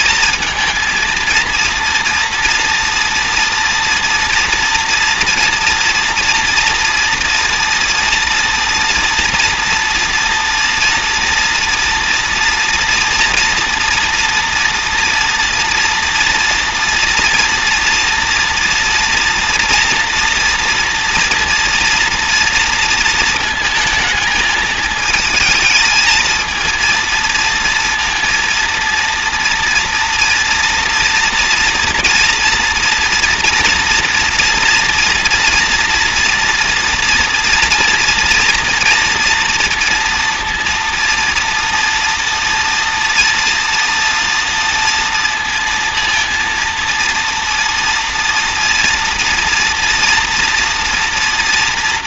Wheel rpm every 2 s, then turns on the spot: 220, 230, 230, 230, 230, 230, 230, 230, 230, 240, 230, 230, 220, 220, 230, 230, 230, 230, 230, 240, 230, 230, 230, 230, 230, 230.
none